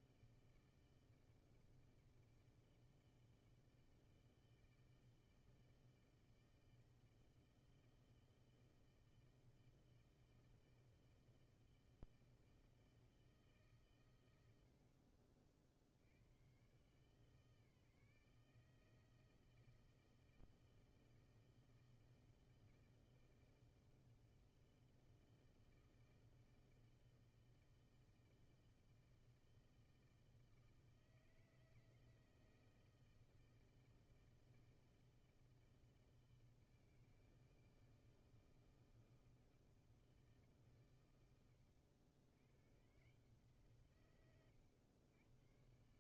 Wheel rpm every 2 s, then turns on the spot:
160, 160, 160, 160, 160, 160, 160, 90, 120, 160, 160, 160, 160, 160, 160, 160, 160, 160, 160, 160, 140, 120, 110.
none